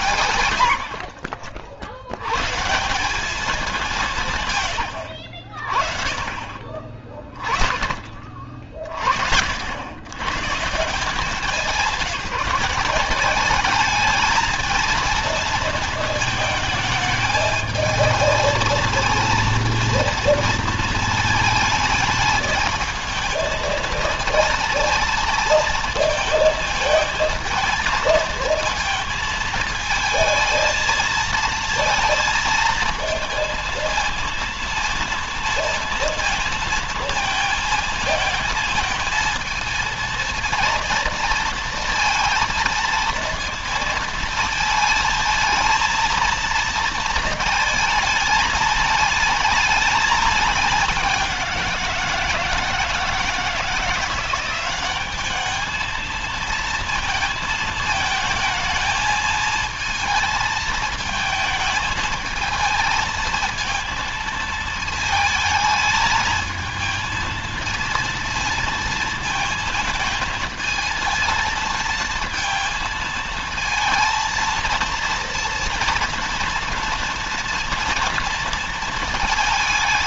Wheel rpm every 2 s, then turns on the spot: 80, 160, 120, 40, 60, 170, 180, 220, 220, 220, 230, 220, 230, 220, 230, 220, 220, 230, 220, 220, 230, 230, 220, 230, 220, 200, 160, 190, 230, 220, 220, 220, 220, 220, 230, 220, 230, 230, 230, 230.
none